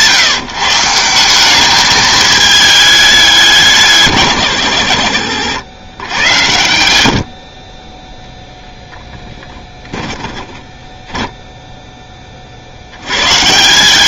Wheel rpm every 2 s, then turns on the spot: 160, 210, 120, 90, 10, 20, 70.
10-12